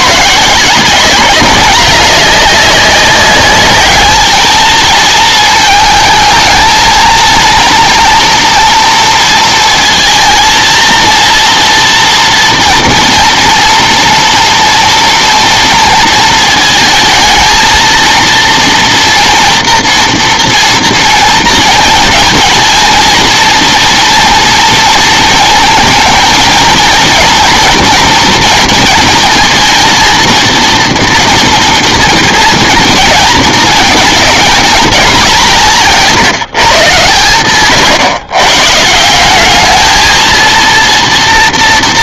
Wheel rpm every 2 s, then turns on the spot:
180, 200, 220, 220, 230, 220, 230, 230, 220, 230, 230, 230, 230, 230, 230, 230, 230, 210, 140, 150, 230.
none